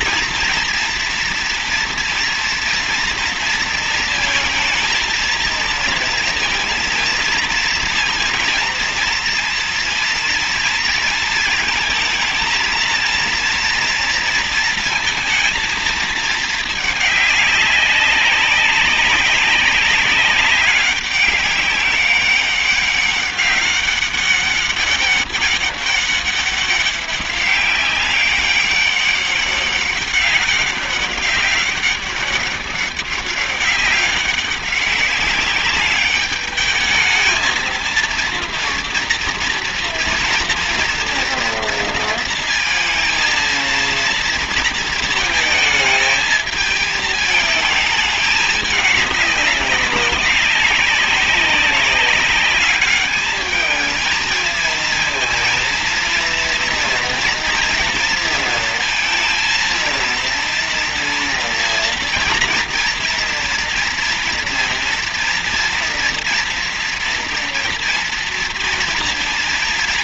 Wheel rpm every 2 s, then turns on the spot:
230, 230, 230, 230, 230, 230, 230, 230, 210, 200, 200, 200, 200, 200, 200, 200, 190, 200, 210, 230, 230, 230, 230, 220, 210, 200, 200, 220, 230, 230, 230, 230, 230, 230, 230.
none